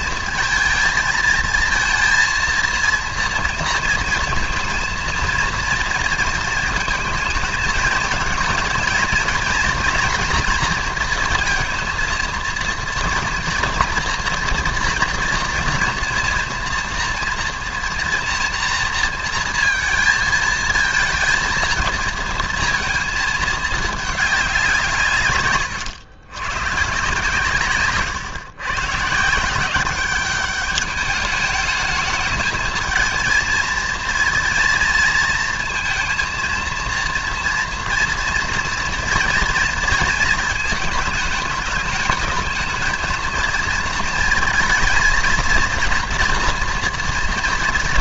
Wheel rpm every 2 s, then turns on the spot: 220, 230, 230, 220, 230, 230, 230, 230, 240, 230, 220, 230, 170, 130, 120, 200, 220, 230, 230, 230, 230, 220, 220, 230.
none